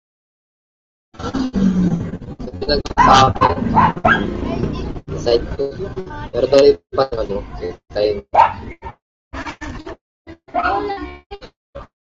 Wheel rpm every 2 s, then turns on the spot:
0, 0, 0, 0, 10, 0.
none